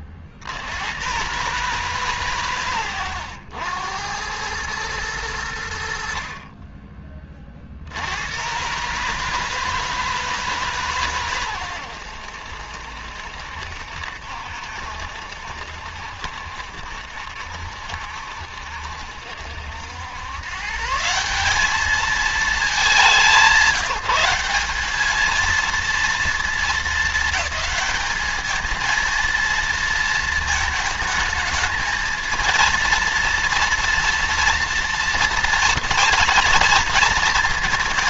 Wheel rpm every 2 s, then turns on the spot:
40, 130, 100, 40, 120, 150, 80, 70, 70, 70, 130, 210, 190, 220, 220, 230, 220, 230, 230.
none